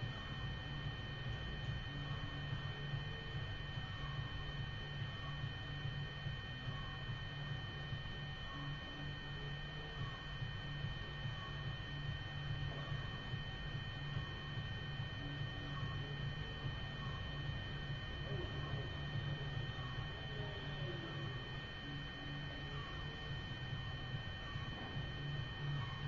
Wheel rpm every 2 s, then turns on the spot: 0, 0, 0, 0, 0, 0, 0, 0, 0, 0, 0, 0, 0.
none